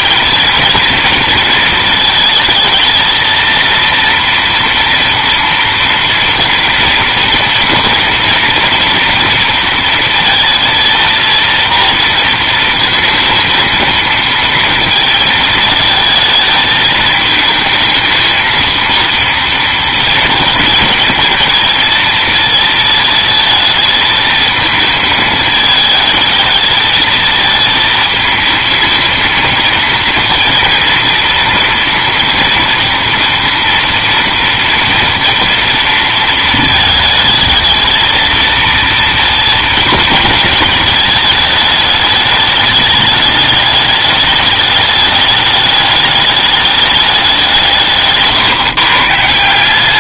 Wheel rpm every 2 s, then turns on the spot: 230, 220, 230, 230, 230, 230, 230, 230, 220, 230, 230, 220, 220, 220, 220, 230, 230, 240, 220, 230, 220, 210, 210, 210, 150.
none